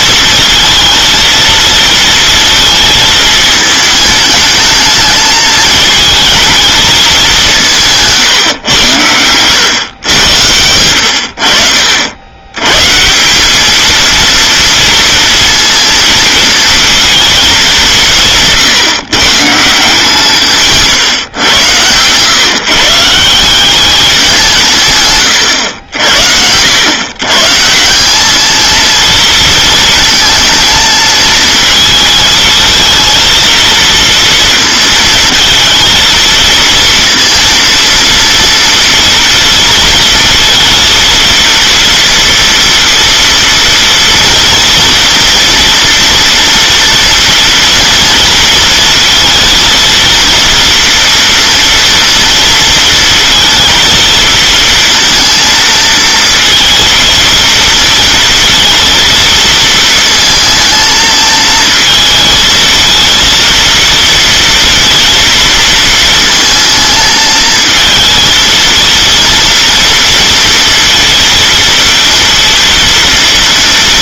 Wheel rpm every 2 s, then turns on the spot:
230, 230, 220, 220, 120, 90, 100, 230, 230, 170, 160, 130, 180, 80, 220, 230, 220, 230, 230, 230, 230, 230, 230, 230, 230, 230, 230, 230, 230, 230, 220, 230, 230, 230, 230, 230, 230.
none